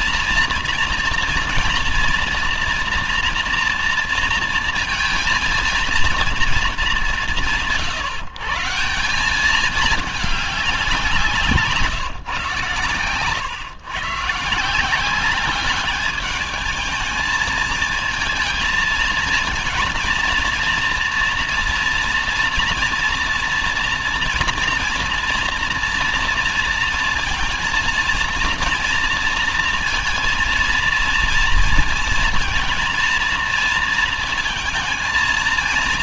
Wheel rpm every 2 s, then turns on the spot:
230, 230, 230, 150, 160, 180, 130, 180, 220, 230, 230, 230, 230, 230, 230, 230, 230, 230.
none